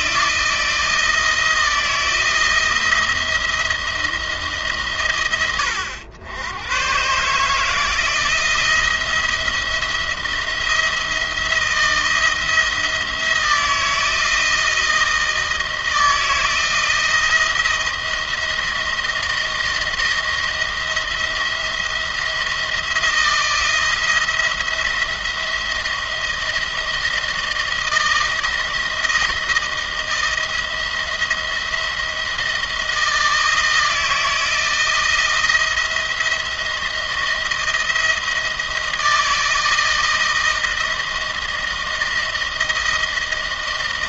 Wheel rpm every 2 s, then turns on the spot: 170, 170, 130, 110, 170, 170, 160, 170, 160, 170, 170, 170, 170, 170, 160, 170, 170, 170, 170, 160, 160, 160.
none